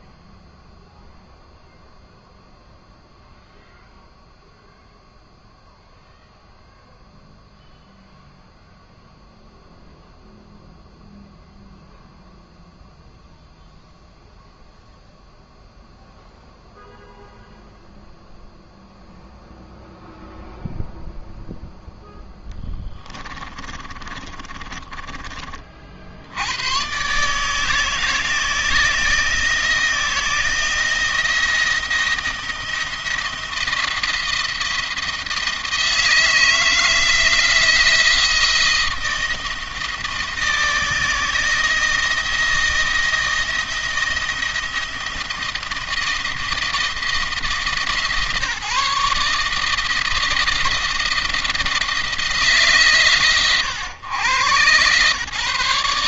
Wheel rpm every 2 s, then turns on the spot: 0, 0, 0, 0, 0, 0, 0, 0, 0, 0, 0, 10, 20, 100, 160, 160, 170, 170, 160, 160, 160, 160, 170, 170, 150, 170, 140, 130.
22-26